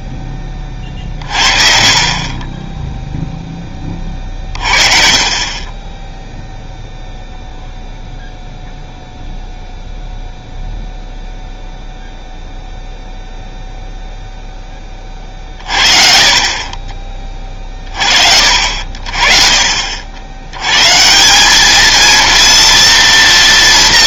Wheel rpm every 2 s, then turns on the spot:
30, 10, 40, 0, 0, 0, 0, 20, 30, 60, 120, 230.
none